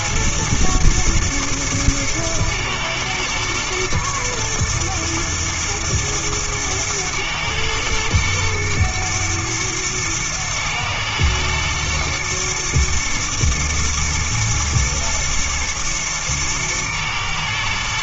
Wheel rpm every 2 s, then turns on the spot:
110, 110, 110, 110, 120, 110, 110, 120, 110.
none